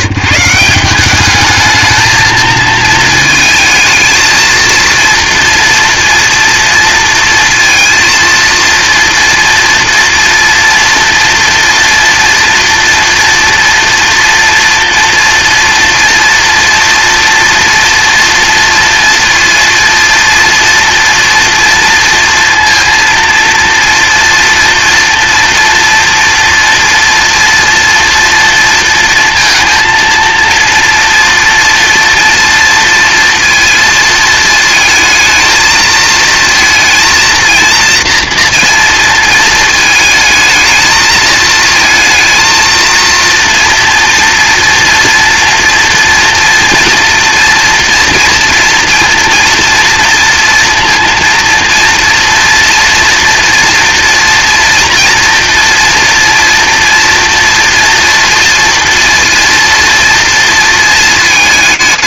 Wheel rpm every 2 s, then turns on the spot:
200, 220, 230, 230, 230, 230, 230, 230, 230, 230, 240, 230, 230, 230, 230, 230, 230, 220, 230, 230, 220, 230, 230, 230, 230, 230, 230, 230, 230, 230, 220.
none